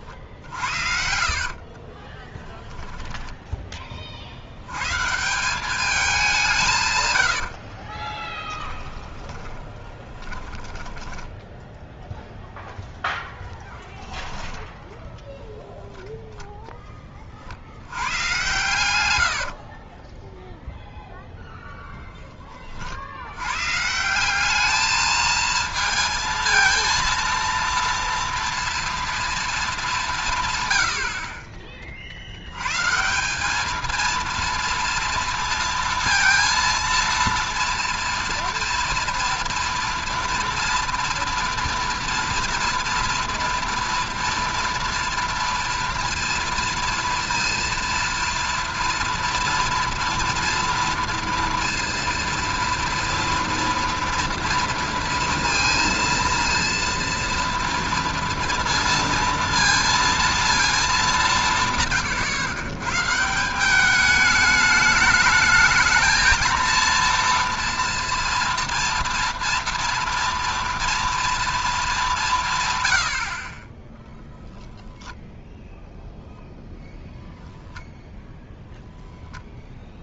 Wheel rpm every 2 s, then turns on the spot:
60, 10, 90, 160, 10, 20, 0, 10, 10, 120, 0, 20, 200, 230, 230, 130, 100, 230, 230, 230, 230, 240, 230, 230, 230, 230, 230, 230, 230, 230, 230, 130, 210, 230, 230, 240, 150, 0, 0, 0.
0-4 10-12